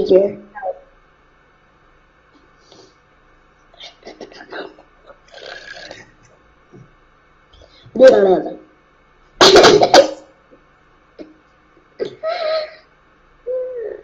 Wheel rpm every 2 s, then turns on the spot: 0, 0, 0, 0, 0, 0, 0.
none